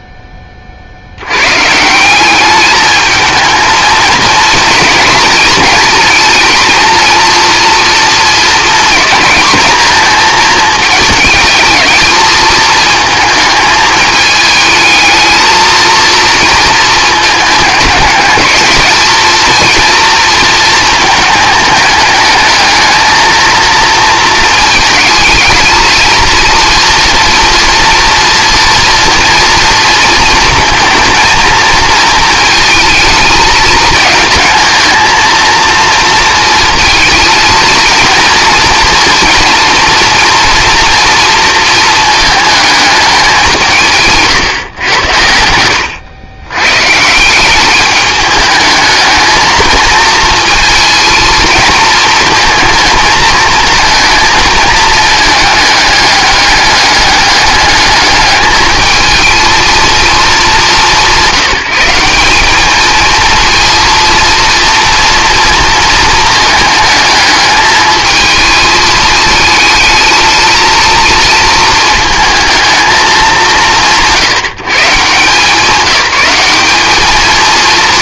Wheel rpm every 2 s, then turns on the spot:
60, 220, 230, 220, 230, 220, 220, 220, 220, 220, 220, 220, 220, 230, 240, 230, 220, 220, 230, 230, 230, 210, 100, 140, 220, 230, 220, 220, 210, 220, 190, 220, 230, 220, 220, 230, 220, 150, 210.
44-46